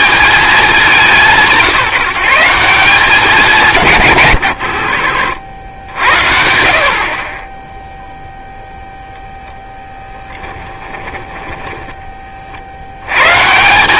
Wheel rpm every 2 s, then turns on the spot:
190, 180, 80, 60, 0, 20, 40.
10-12